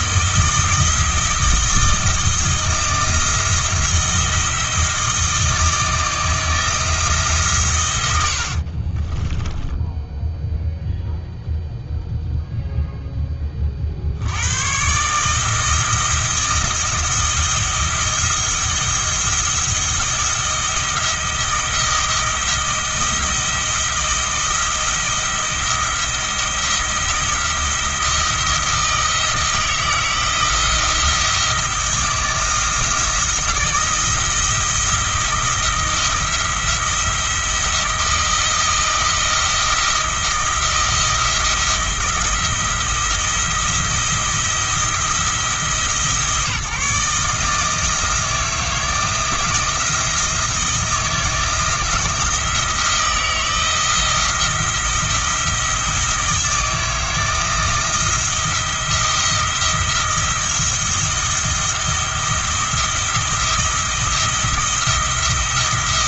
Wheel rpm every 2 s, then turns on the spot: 160, 160, 160, 160, 40, 0, 0, 130, 170, 170, 170, 170, 170, 170, 160, 170, 170, 160, 170, 160, 170, 170, 170, 150, 170, 170, 170, 170, 170, 170, 170, 170, 170.
8-10